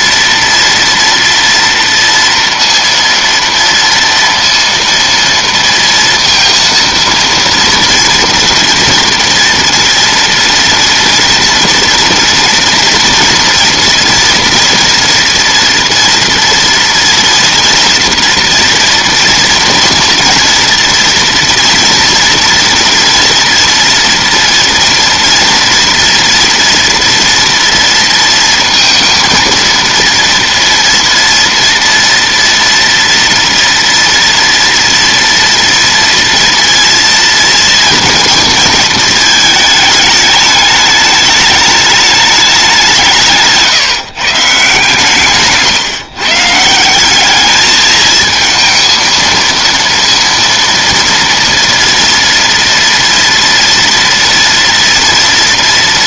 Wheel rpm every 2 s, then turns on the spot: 230, 230, 230, 230, 230, 230, 230, 230, 230, 230, 240, 230, 240, 230, 230, 230, 230, 230, 230, 230, 210, 180, 160, 160, 220, 230, 230, 230.
none